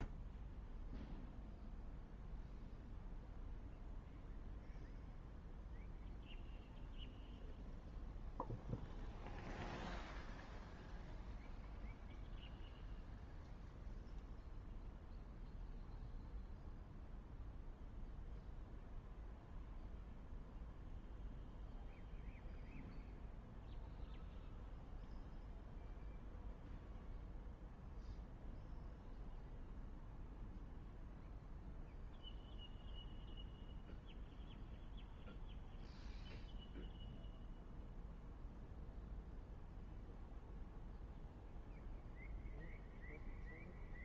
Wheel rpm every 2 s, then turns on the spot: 0, 0, 0, 0, 0, 0, 0, 0, 0, 0, 0, 0, 0, 0, 0, 0, 0, 0, 0, 0, 0, 0.
none